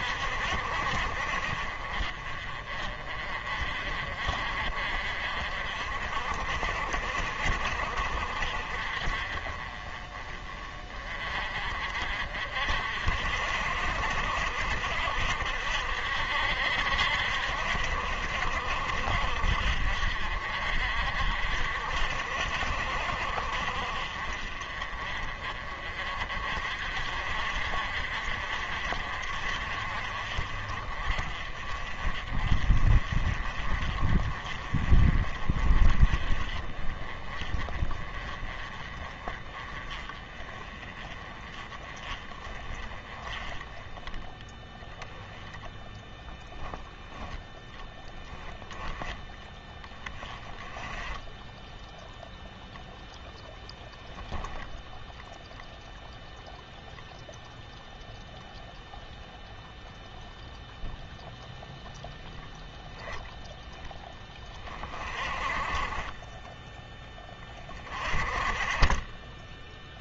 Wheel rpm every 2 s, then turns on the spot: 50, 40, 40, 50, 40, 30, 50, 60, 60, 60, 50, 60, 40, 50, 50, 40, 40, 40, 30, 30, 20, 30, 10, 10, 10, 10, 0, 0, 0, 0, 0, 0, 20, 10, 20.
none